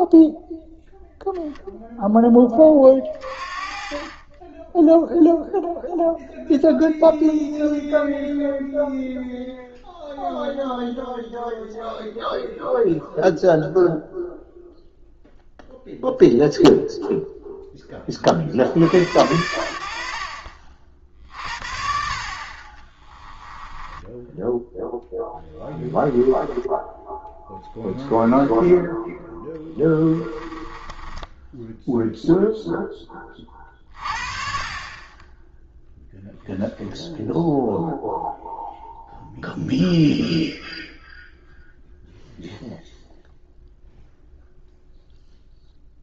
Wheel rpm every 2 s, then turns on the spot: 0, 30, 0, 0, 0, 0, 0, 0, 0, 70, 50, 30, 10, 10, 10, 20, 0, 30, 0, 0, 0, 0, 0.
22-24 26-32